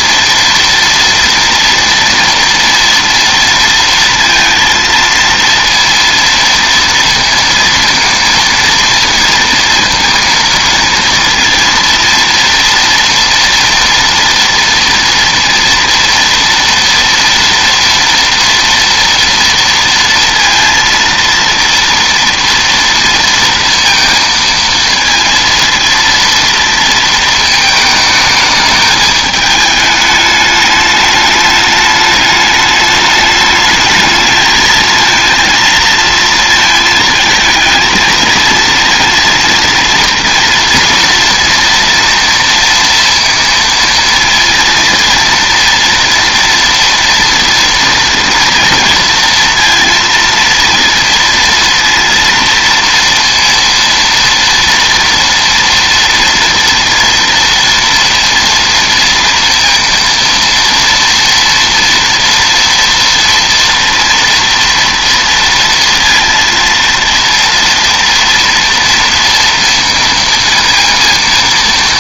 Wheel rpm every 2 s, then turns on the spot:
230, 240, 230, 230, 230, 230, 230, 230, 230, 230, 230, 230, 230, 230, 210, 210, 210, 220, 220, 230, 230, 230, 230, 230, 230, 230, 230, 230, 230, 230, 230, 230, 230, 230, 230, 230.
none